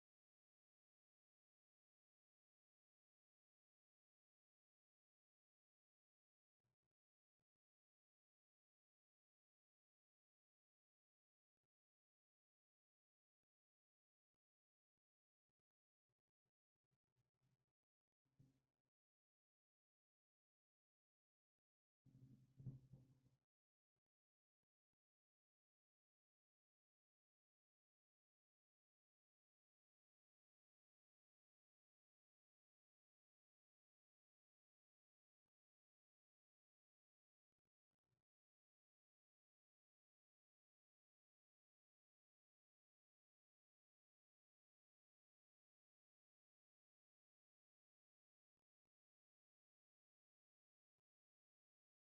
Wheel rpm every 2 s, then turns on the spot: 0, 0, 0, 0, 0, 0, 0, 0, 0, 0, 0, 0, 0, 0, 0, 0, 0, 0, 0, 0, 0, 0, 0, 0, 0, 0.
none